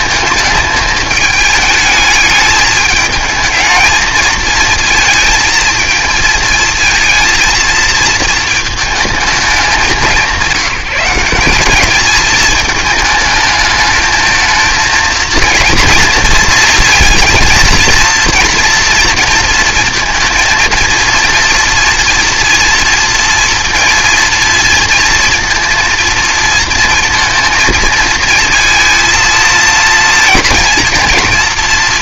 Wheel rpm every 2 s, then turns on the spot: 220, 210, 220, 220, 220, 190, 220, 220, 230, 240, 230, 230, 230, 230, 230, 230.
none